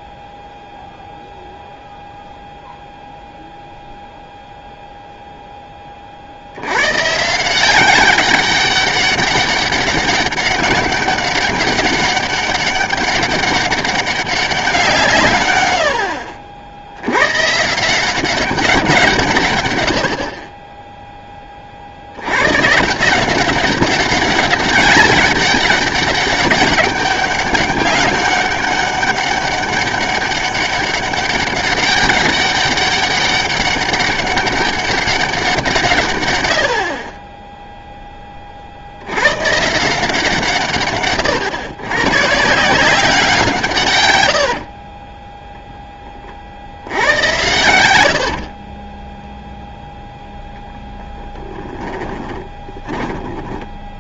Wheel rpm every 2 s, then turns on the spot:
0, 0, 0, 90, 200, 200, 200, 180, 70, 180, 20, 140, 200, 200, 200, 200, 200, 200, 80, 60, 140, 170, 50, 70, 30, 0, 20.
44-46 48-50 52-54